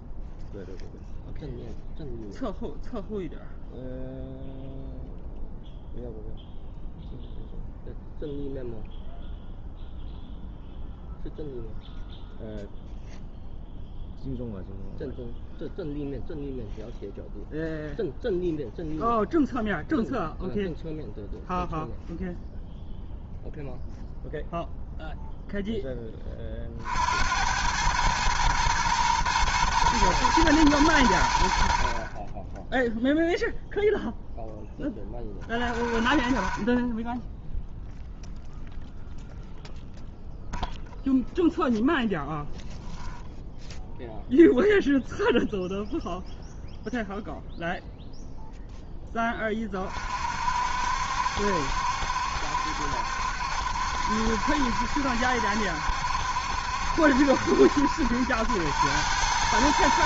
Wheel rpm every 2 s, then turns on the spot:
0, 0, 0, 0, 0, 0, 0, 0, 0, 0, 0, 0, 0, 40, 110, 110, 10, 10, 30, 0, 0, 0, 0, 0, 0, 60, 70, 70, 70, 90.
none